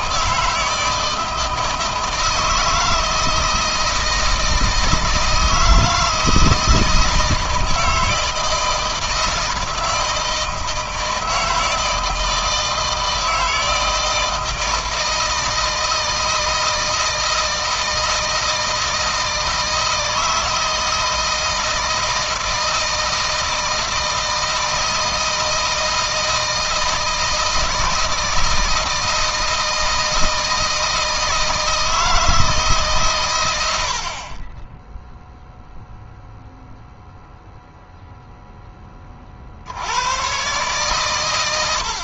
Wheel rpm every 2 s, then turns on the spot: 160, 160, 160, 160, 160, 160, 160, 170, 160, 160, 160, 160, 160, 160, 160, 160, 140, 10, 0, 20, 120.
none